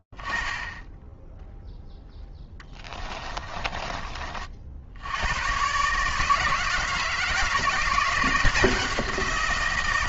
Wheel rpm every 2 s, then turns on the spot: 10, 10, 50, 150, 170.
2-4